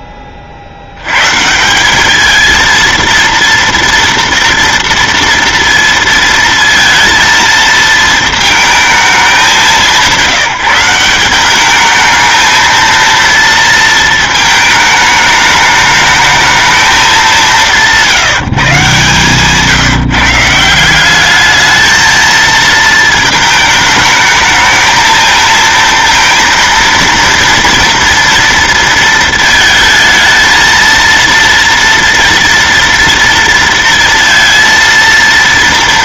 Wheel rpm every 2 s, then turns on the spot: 80, 230, 230, 230, 230, 180, 220, 220, 220, 140, 170, 220, 220, 230, 230, 230, 230, 230.
none